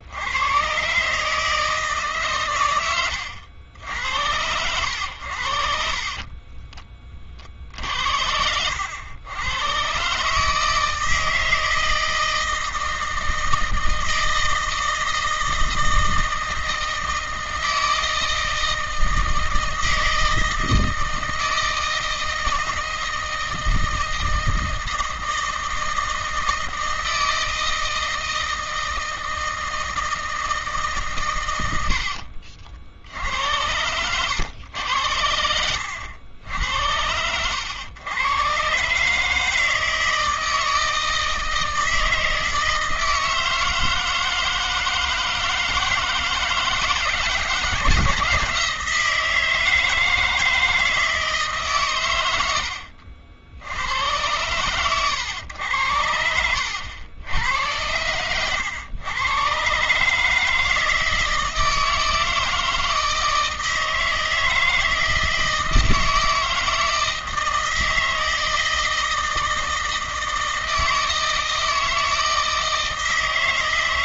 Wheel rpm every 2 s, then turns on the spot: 130, 100, 90, 20, 90, 160, 160, 160, 160, 160, 160, 160, 160, 160, 160, 140, 70, 90, 80, 140, 160, 160, 160, 160, 160, 160, 70, 120, 90, 110, 160, 160, 160, 160, 160, 160, 160.
none